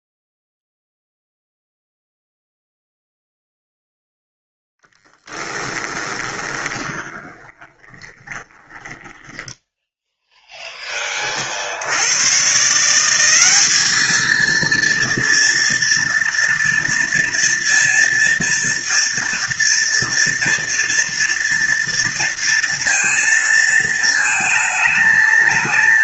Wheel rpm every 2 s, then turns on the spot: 0, 0, 10, 20, 10, 20, 190, 230, 230, 230, 230, 230, 220.
4-10